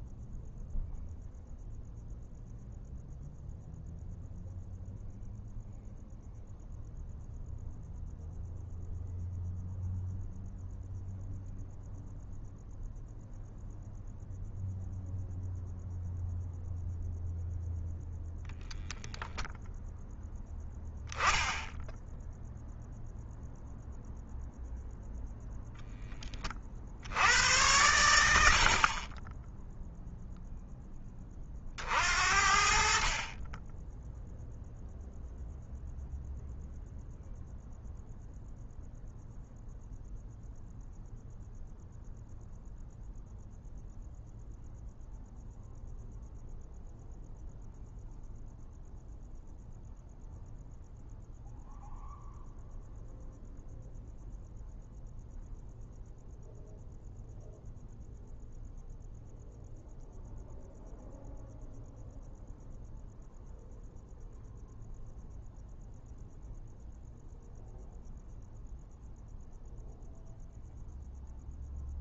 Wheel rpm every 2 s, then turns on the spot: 0, 0, 0, 0, 0, 0, 0, 0, 0, 0, 0, 0, 0, 30, 70, 0, 50, 0, 0, 0, 0, 0, 0, 0, 0, 0, 0, 0, 0, 0, 0, 0, 0, 0, 0, 0.
none